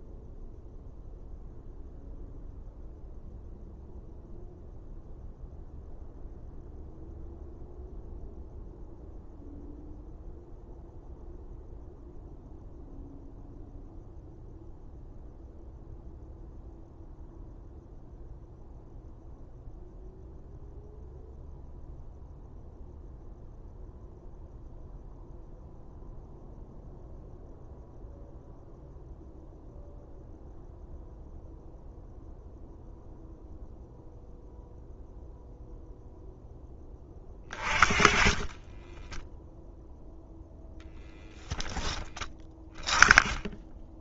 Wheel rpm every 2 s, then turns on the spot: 0, 0, 0, 0, 0, 0, 0, 0, 0, 0, 0, 0, 0, 0, 0, 0, 0, 0, 20, 20, 0, 10.
38-40